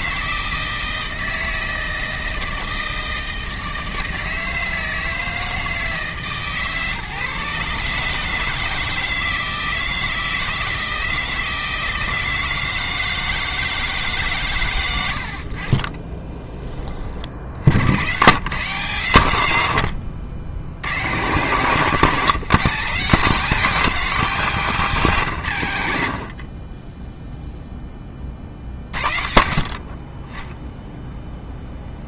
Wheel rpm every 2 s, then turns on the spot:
160, 160, 160, 140, 160, 160, 160, 120, 20, 130, 80, 150, 170, 30, 40, 10.
none